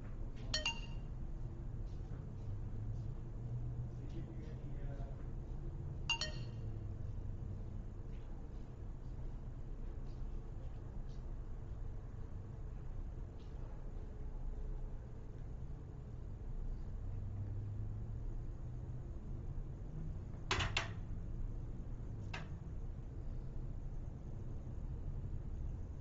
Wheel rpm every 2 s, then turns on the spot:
0, 0, 0, 0, 0, 0, 0, 0, 0, 0, 0, 0, 0.
none